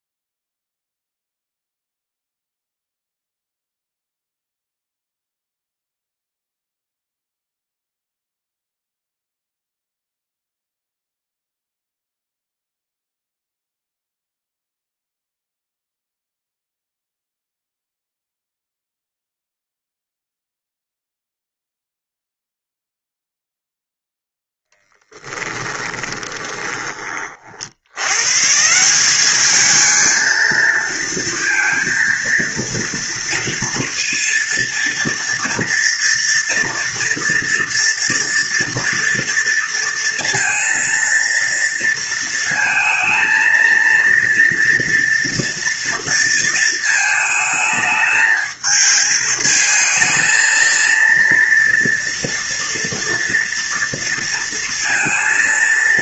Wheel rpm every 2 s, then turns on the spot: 0, 0, 0, 0, 0, 0, 0, 0, 0, 0, 0, 0, 0, 20, 150, 230, 230, 240, 240, 230, 230, 230, 230, 220, 220, 230, 230, 230.
26-28